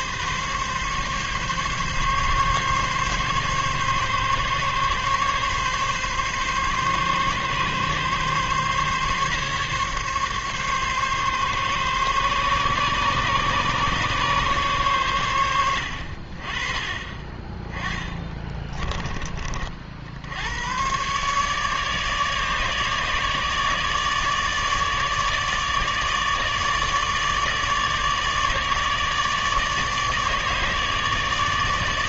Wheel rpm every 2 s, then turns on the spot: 140, 140, 140, 140, 140, 140, 140, 130, 30, 20, 110, 150, 150, 150, 150, 150.
18-20